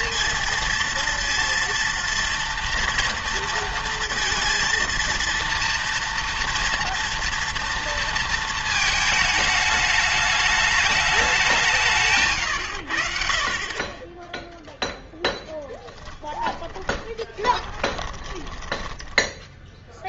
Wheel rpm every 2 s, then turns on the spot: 230, 230, 230, 230, 230, 210, 100, 0, 20, 10.
16-20